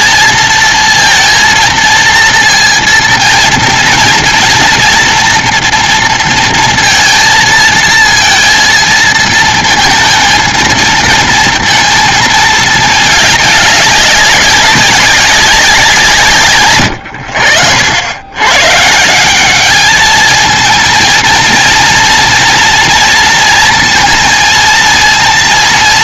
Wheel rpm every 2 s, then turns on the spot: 230, 230, 230, 230, 230, 220, 220, 200, 160, 90, 220, 230, 230.
none